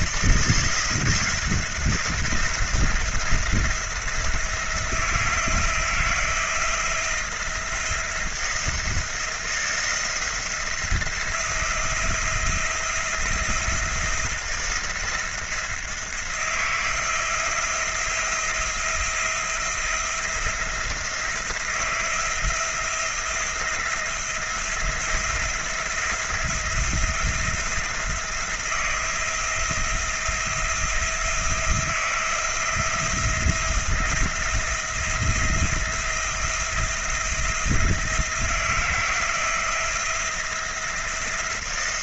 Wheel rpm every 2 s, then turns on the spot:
170, 170, 170, 170, 170, 170, 170, 170, 170, 170, 170, 170, 170, 170, 170, 170, 170, 170, 170, 170, 170.
none